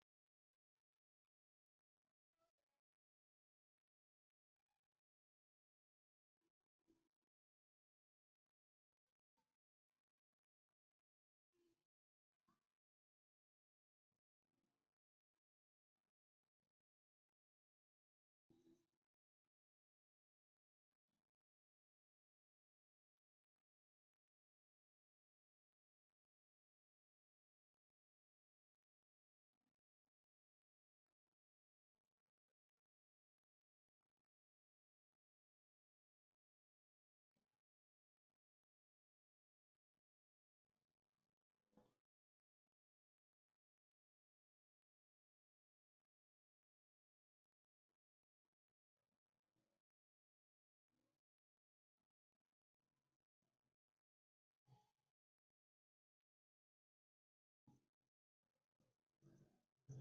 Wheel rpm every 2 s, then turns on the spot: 0, 0, 0, 0, 0, 0, 0, 0, 0, 0, 0, 0, 0, 0, 0, 0, 0, 0, 0, 0, 0, 0, 0, 0, 0, 0, 0, 0, 0, 0.
none